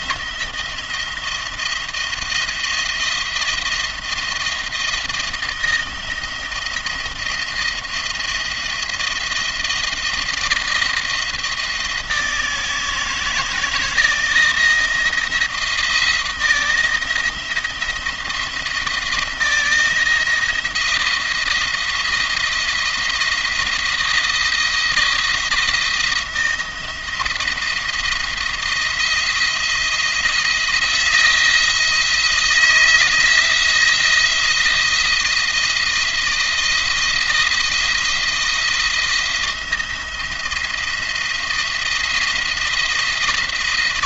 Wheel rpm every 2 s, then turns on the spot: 170, 170, 170, 170, 170, 160, 160, 160, 170, 170, 170, 160, 170, 170, 170, 170, 170, 170, 170, 170, 170, 170.
none